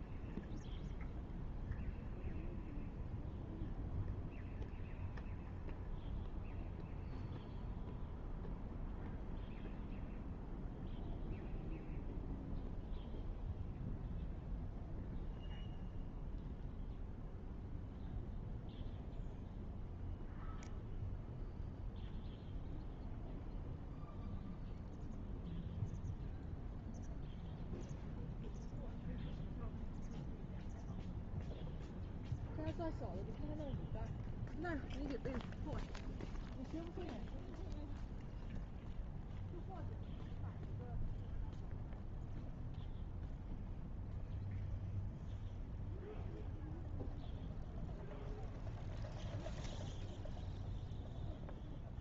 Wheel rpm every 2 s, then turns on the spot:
0, 0, 0, 0, 0, 0, 0, 0, 0, 0, 0, 0, 0, 0, 0, 0, 0, 0, 0, 0, 0, 0, 0, 0, 0, 0.
none